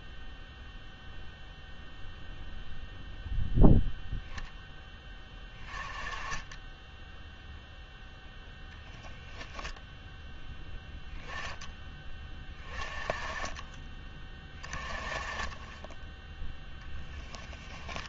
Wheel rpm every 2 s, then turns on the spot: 0, 0, 10, 10, 0, 0, 20, 30, 0.
none